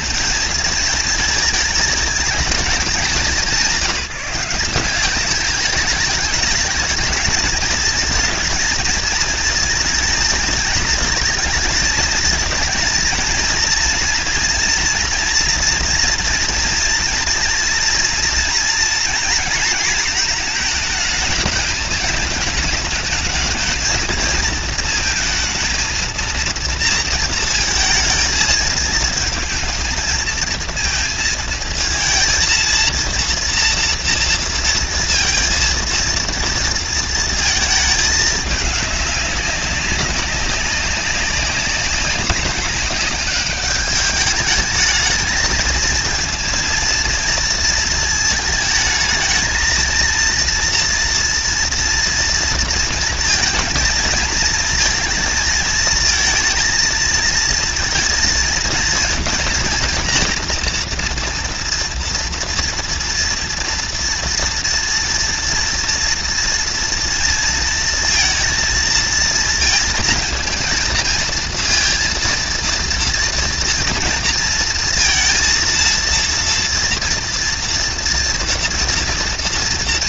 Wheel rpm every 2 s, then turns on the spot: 220, 210, 180, 210, 220, 230, 230, 240, 230, 230, 230, 210, 230, 230, 220, 230, 230, 230, 230, 210, 190, 200, 220, 230, 220, 230, 230, 220, 220, 220, 230, 230, 230, 230, 230, 230, 230, 230, 240, 230.
none